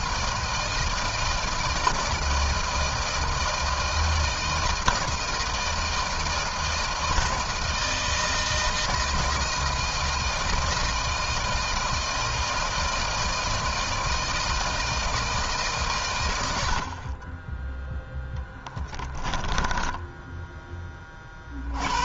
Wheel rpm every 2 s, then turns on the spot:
160, 160, 160, 160, 160, 160, 160, 160, 70, 10, 10.
18-20